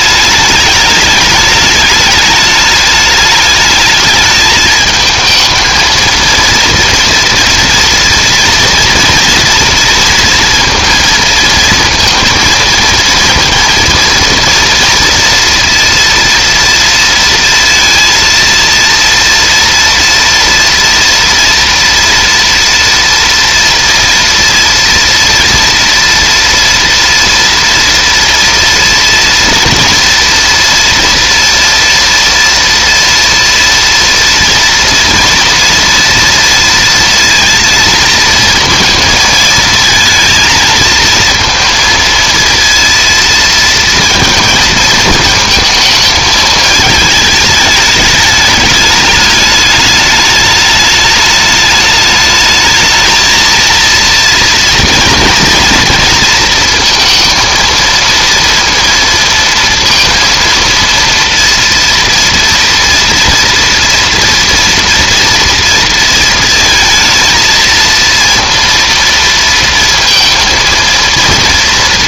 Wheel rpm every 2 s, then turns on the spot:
210, 210, 220, 230, 230, 230, 230, 240, 230, 230, 230, 230, 230, 230, 230, 230, 230, 230, 230, 230, 220, 230, 230, 220, 210, 210, 220, 230, 230, 230, 230, 230, 230, 230, 230, 230.
none